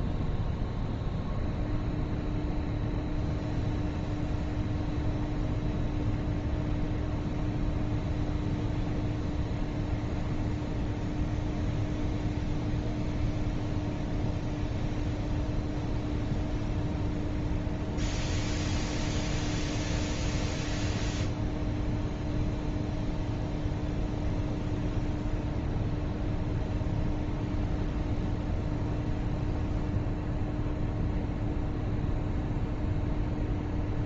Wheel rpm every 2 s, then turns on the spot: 0, 0, 0, 0, 0, 0, 0, 0, 0, 0, 0, 0, 0, 0, 0, 0, 0.
none